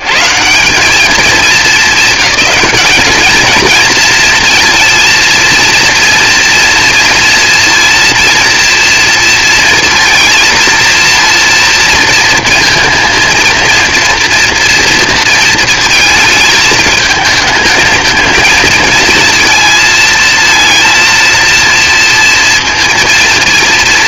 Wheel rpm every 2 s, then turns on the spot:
220, 210, 230, 230, 230, 230, 230, 230, 220, 230, 230, 230.
none